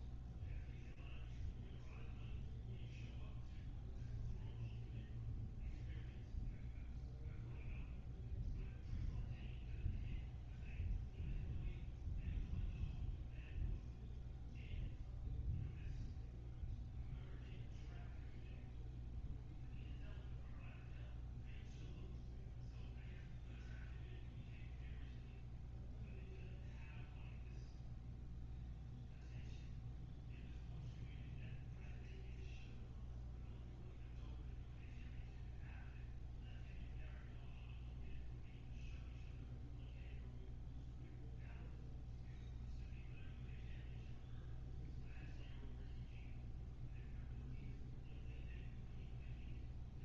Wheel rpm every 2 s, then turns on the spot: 0, 0, 0, 0, 0, 0, 0, 0, 0, 0, 0, 0, 0, 0, 0, 0, 0, 0, 0, 0, 0, 0, 0, 0, 0.
none